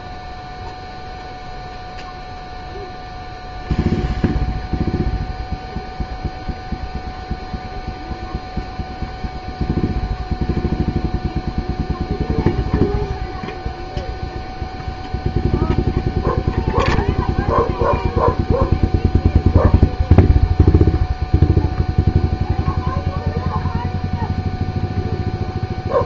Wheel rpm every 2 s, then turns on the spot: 0, 0, 0, 0, 0, 0, 0, 0, 0, 0, 0, 0, 0.
none